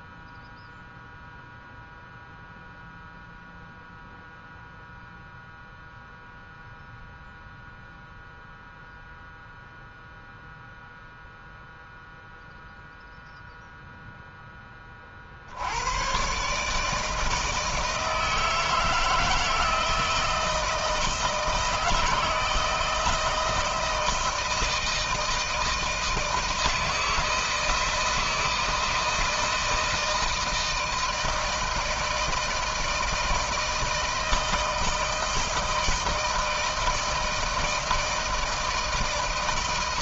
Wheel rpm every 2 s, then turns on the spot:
0, 0, 0, 0, 0, 0, 0, 30, 150, 160, 160, 160, 160, 160, 160, 160, 160, 160, 160, 140.
none